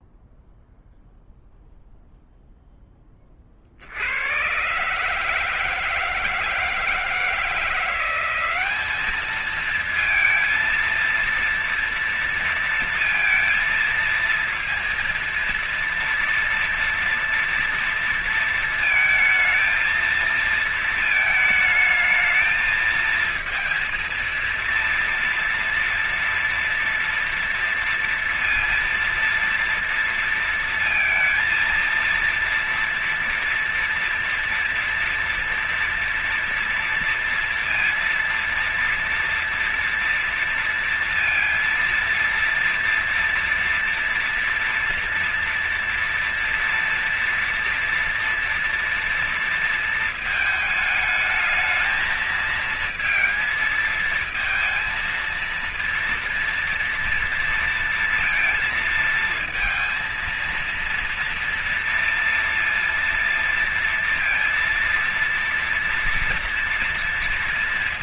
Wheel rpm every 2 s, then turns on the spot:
0, 0, 90, 160, 180, 220, 230, 230, 230, 230, 230, 220, 230, 230, 230, 230, 230, 230, 230, 230, 230, 230, 230, 230, 230, 220, 220, 220, 230, 230, 220, 230, 230, 240.
none